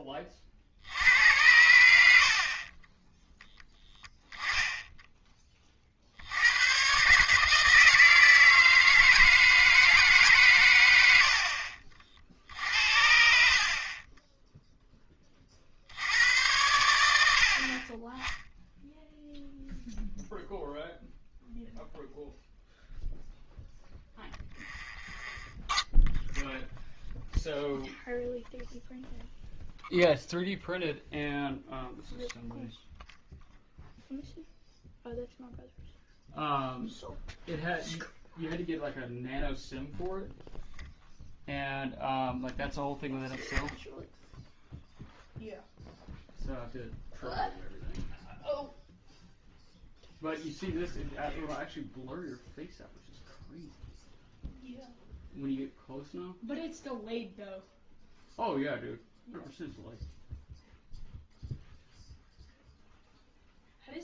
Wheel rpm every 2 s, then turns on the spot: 50, 40, 0, 110, 160, 120, 60, 10, 100, 0, 0, 0, 0, 0, 0, 0, 0, 0, 0, 0, 0, 0, 0, 0, 0, 0, 0, 0, 0, 0, 0, 0.
none